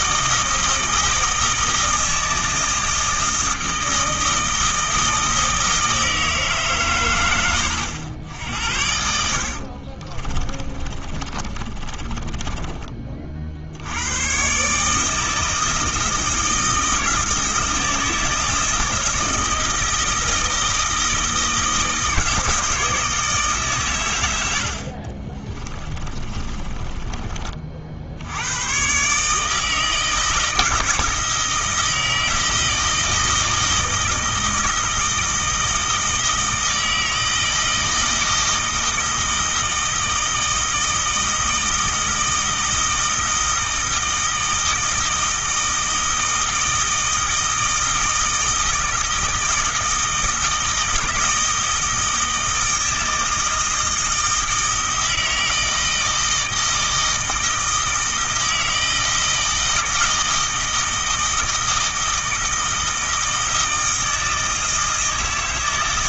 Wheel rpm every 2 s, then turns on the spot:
160, 160, 160, 130, 70, 30, 20, 150, 160, 160, 160, 160, 50, 20, 120, 160, 160, 160, 160, 160, 160, 160, 160, 160, 160, 160, 160, 160, 160, 160, 160, 160, 160.
10-12 26-28